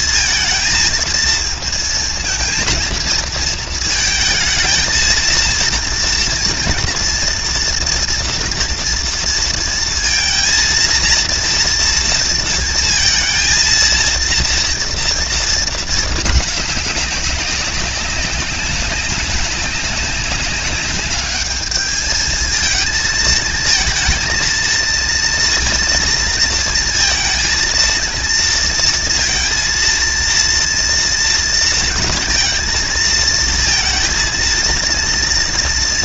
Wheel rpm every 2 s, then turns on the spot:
230, 230, 220, 230, 230, 230, 230, 230, 210, 190, 190, 220, 230, 230, 230, 230, 230, 230.
none